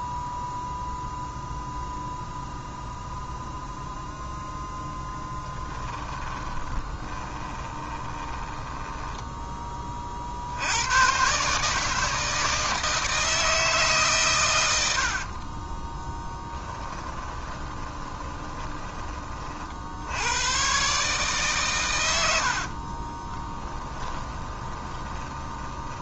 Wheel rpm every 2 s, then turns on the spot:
0, 0, 10, 20, 10, 110, 160, 80, 10, 30, 140, 30, 10.
4-10 16-20 22-26